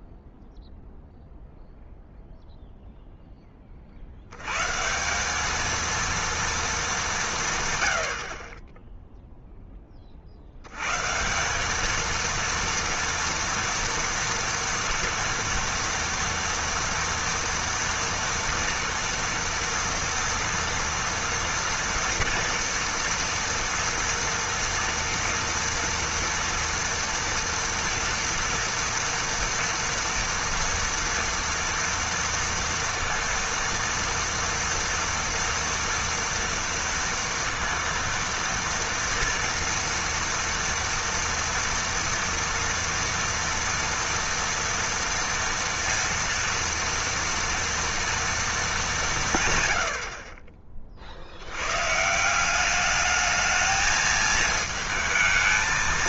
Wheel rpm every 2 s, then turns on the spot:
0, 0, 190, 170, 0, 180, 230, 230, 230, 230, 230, 230, 230, 230, 230, 230, 230, 230, 230, 230, 240, 230, 230, 230, 150, 70, 210, 220.
none